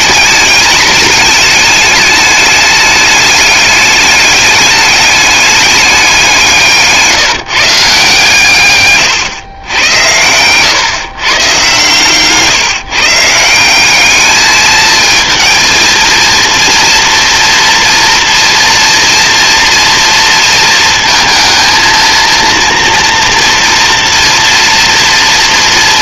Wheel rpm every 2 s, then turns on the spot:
210, 210, 200, 160, 140, 130, 150, 220, 230, 240, 230, 230, 240.
6-8